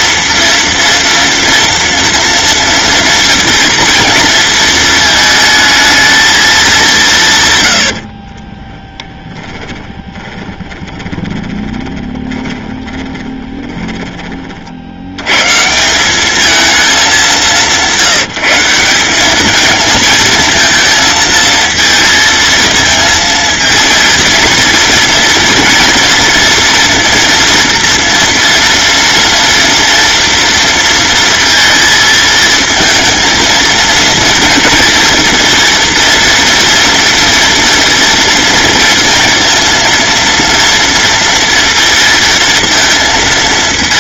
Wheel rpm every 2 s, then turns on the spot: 230, 230, 220, 180, 20, 20, 30, 70, 210, 190, 220, 230, 230, 230, 230, 230, 230, 230, 230, 230, 230, 220.
10-14